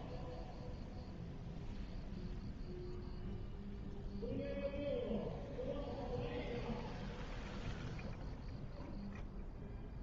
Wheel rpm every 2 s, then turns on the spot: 0, 0, 0, 0, 0.
none